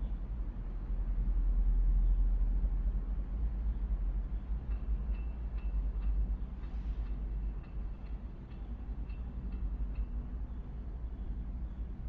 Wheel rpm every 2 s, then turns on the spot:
0, 0, 0, 0, 0, 0.
none